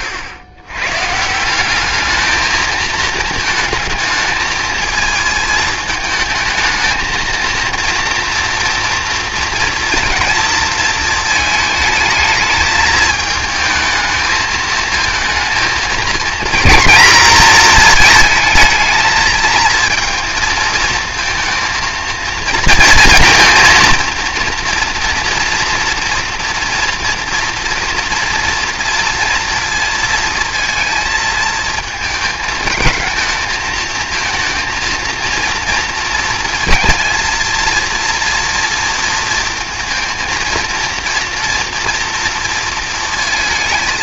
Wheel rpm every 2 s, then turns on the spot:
110, 220, 220, 220, 230, 220, 220, 220, 240, 220, 230, 220, 230, 240, 230, 230, 220, 230, 230, 230, 230, 230.
none